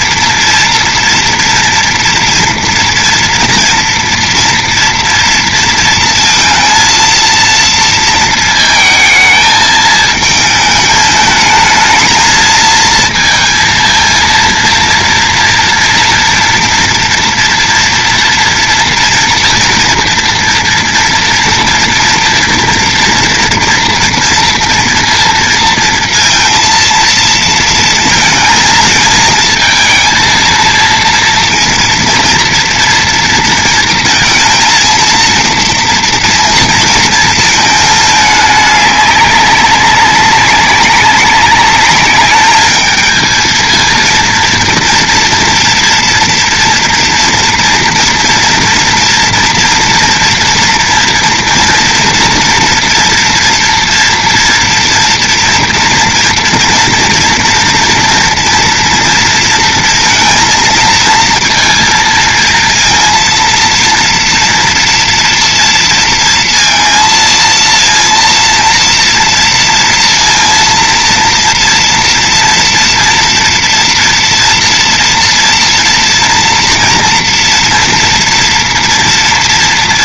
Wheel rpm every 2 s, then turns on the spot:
240, 230, 240, 230, 220, 220, 220, 230, 230, 230, 240, 230, 230, 230, 220, 230, 230, 220, 230, 200, 190, 210, 230, 230, 240, 230, 230, 240, 230, 230, 230, 230, 240, 230, 230, 230, 230, 230, 230, 230.
none